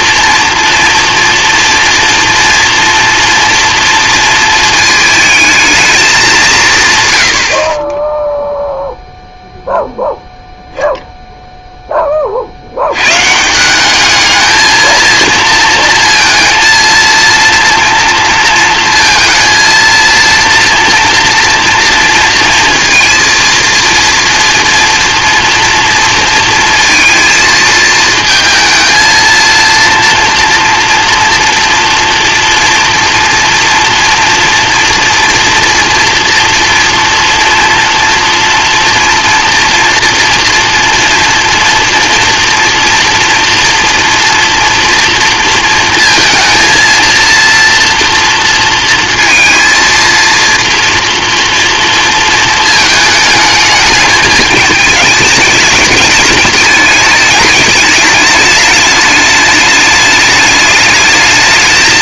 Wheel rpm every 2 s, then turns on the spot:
240, 230, 230, 150, 0, 0, 80, 220, 230, 220, 230, 230, 230, 230, 230, 240, 230, 230, 230, 230, 230, 230, 230, 230, 230, 230, 230, 210, 210, 210, 210.
none